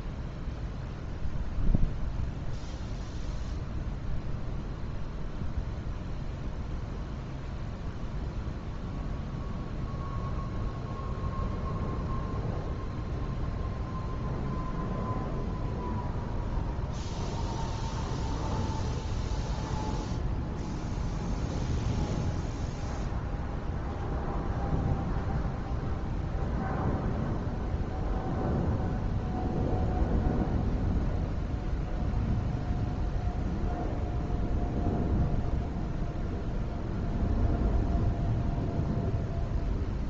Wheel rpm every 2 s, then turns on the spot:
0, 0, 0, 0, 0, 0, 0, 0, 0, 0, 0, 0, 0, 0, 0, 0, 0, 0, 0, 0.
none